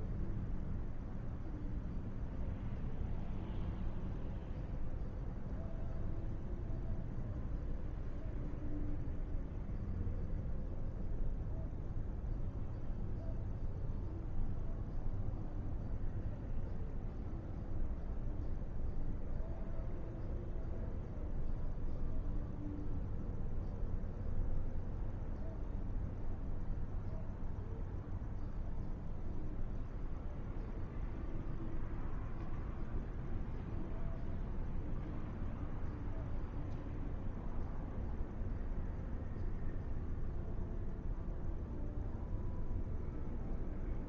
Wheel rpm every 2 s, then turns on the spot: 0, 0, 0, 0, 0, 0, 0, 0, 0, 0, 0, 0, 0, 0, 0, 0, 0, 0, 0, 0, 0, 0.
none